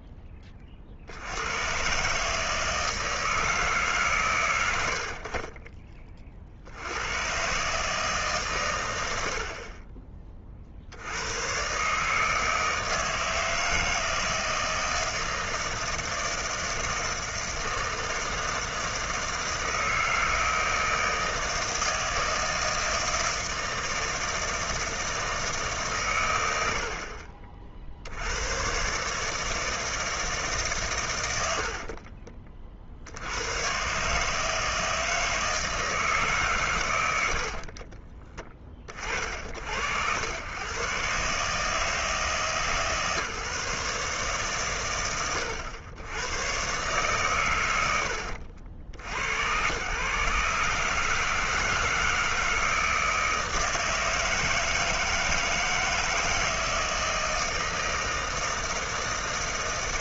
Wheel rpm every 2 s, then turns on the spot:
30, 160, 100, 70, 120, 50, 160, 160, 160, 160, 160, 160, 160, 90, 120, 140, 30, 160, 140, 10, 110, 140, 140, 120, 70, 140, 160, 160, 160, 160.
38-40